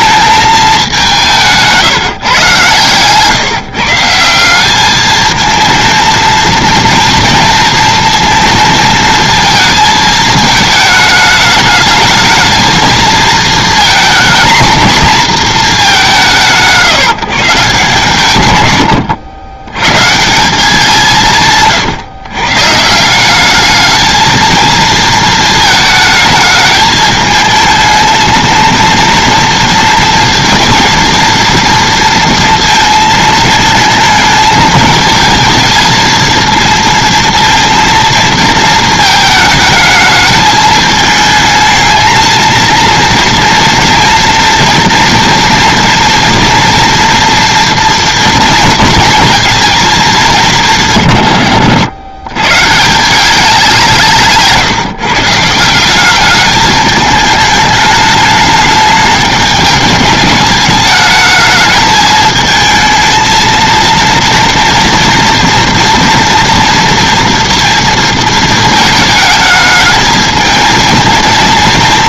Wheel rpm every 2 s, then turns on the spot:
200, 120, 200, 230, 230, 220, 220, 230, 160, 110, 180, 150, 220, 210, 230, 230, 230, 220, 230, 220, 220, 230, 230, 240, 230, 160, 150, 150, 210, 210, 210, 220, 230, 240, 220, 220.
none